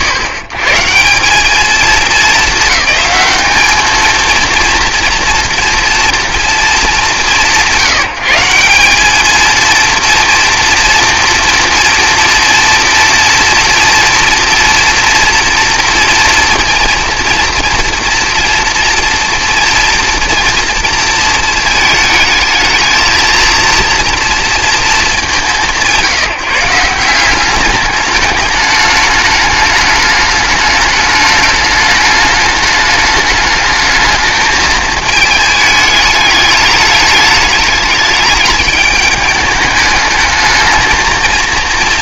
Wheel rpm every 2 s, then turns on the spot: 150, 210, 230, 200, 190, 230, 230, 230, 230, 230, 230, 220, 210, 170, 210, 210, 210, 220, 210, 210, 220.
none